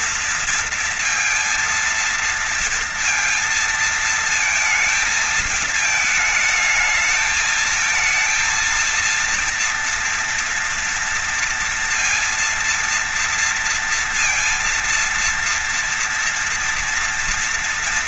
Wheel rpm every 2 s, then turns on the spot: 230, 230, 220, 220, 230, 230, 230, 230, 230.
none